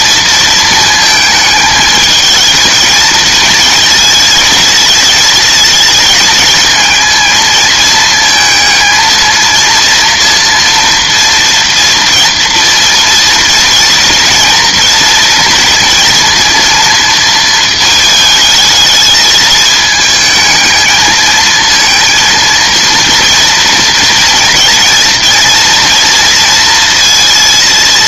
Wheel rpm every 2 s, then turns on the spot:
220, 220, 220, 220, 220, 230, 230, 230, 230, 220, 220, 230, 230, 230.
none